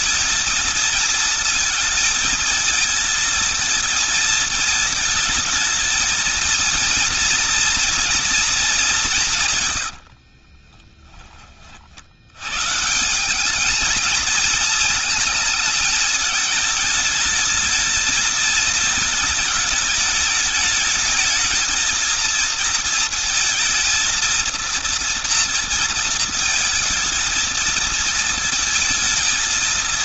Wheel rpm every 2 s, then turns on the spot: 220, 220, 220, 230, 190, 20, 140, 230, 210, 210, 210, 230, 230, 230, 220.
8-12